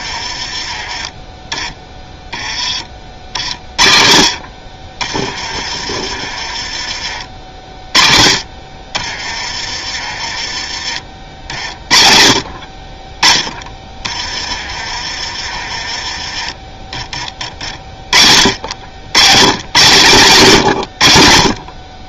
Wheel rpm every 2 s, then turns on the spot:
30, 30, 40, 30, 30, 30, 50, 30, 20, 70, 130.
none